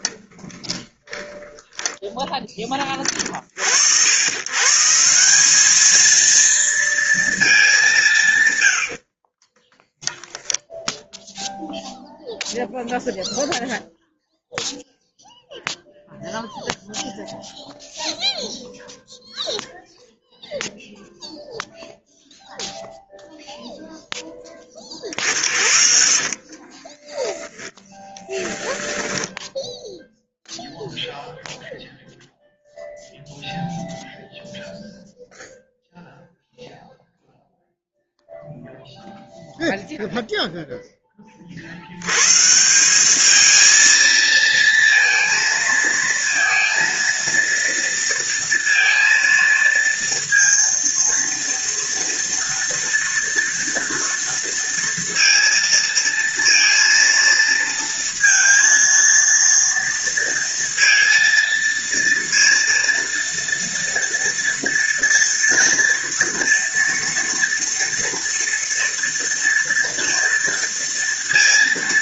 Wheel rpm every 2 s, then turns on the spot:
10, 30, 180, 220, 40, 0, 0, 0, 0, 0, 0, 0, 50, 10, 10, 0, 0, 0, 0, 0, 30, 210, 230, 230, 230, 230, 230, 230, 230, 230, 230, 230, 240, 230, 230, 230.
0-2 8-10 26-28